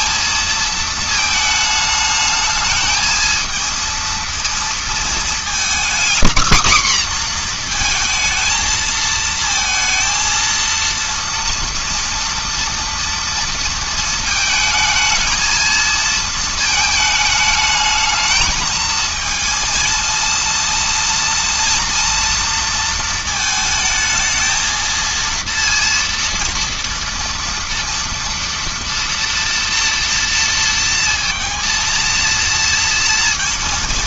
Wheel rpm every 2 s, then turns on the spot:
220, 220, 230, 250, 220, 230, 230, 220, 220, 220, 230, 230, 230, 230, 240, 230, 230.
none